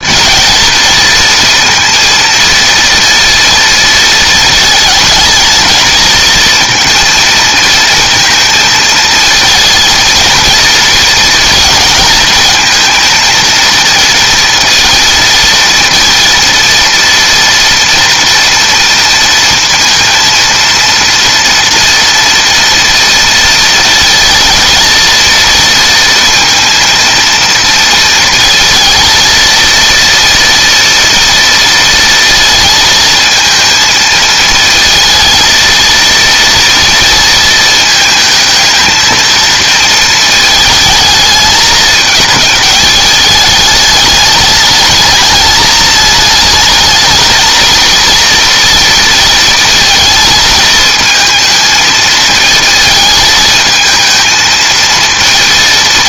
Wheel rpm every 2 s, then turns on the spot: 220, 230, 230, 230, 230, 230, 230, 230, 230, 230, 230, 240, 230, 230, 230, 240, 230, 220, 230, 220, 220, 220, 220, 220, 230, 220, 220, 220.
none